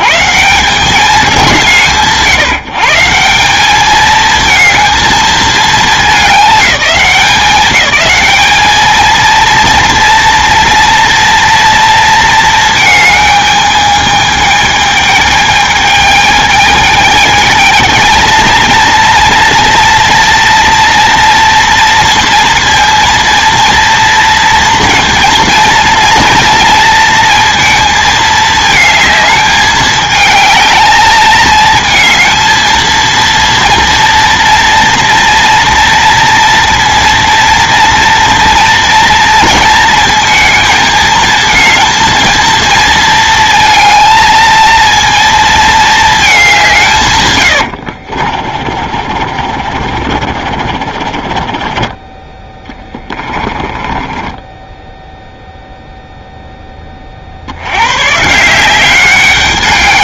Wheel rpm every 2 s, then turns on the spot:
190, 160, 220, 200, 210, 230, 220, 210, 220, 230, 240, 230, 230, 230, 220, 210, 230, 230, 230, 230, 220, 230, 220, 190, 40, 50, 20, 10, 10, 180.
48-56